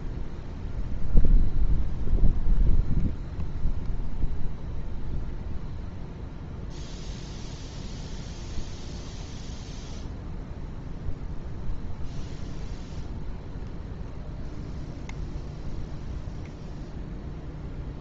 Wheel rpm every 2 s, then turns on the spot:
0, 0, 0, 0, 0, 0, 0, 0, 0.
none